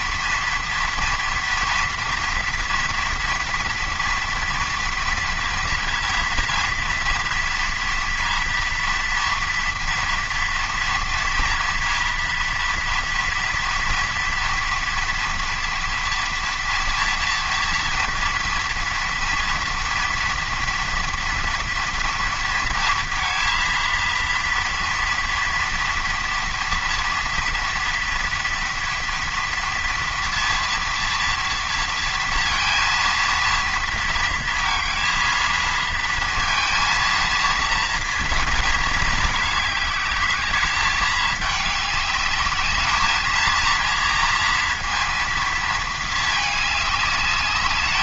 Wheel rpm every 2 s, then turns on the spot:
230, 230, 230, 230, 230, 230, 230, 230, 230, 230, 230, 230, 230, 240, 230, 230, 230, 230, 230, 220, 210, 210, 230, 210.
none